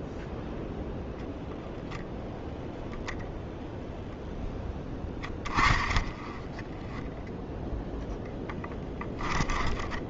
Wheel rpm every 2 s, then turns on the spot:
0, 0, 20, 10, 20.
4-6 8-10